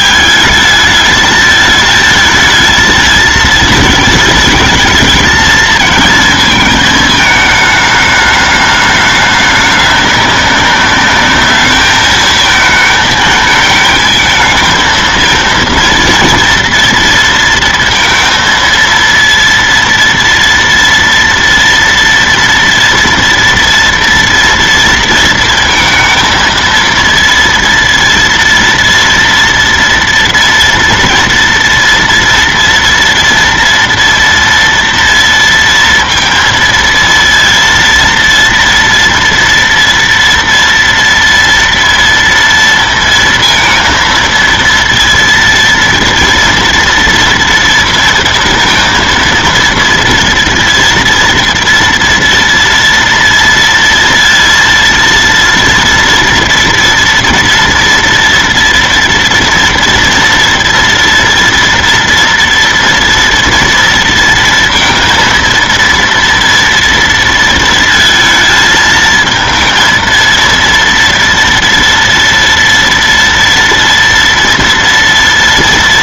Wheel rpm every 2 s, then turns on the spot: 220, 220, 220, 220, 210, 200, 220, 220, 230, 230, 230, 240, 230, 230, 230, 240, 230, 230, 230, 230, 230, 230, 230, 230, 230, 230, 230, 230, 230, 230, 240, 230, 230, 230, 220, 230, 230, 230.
none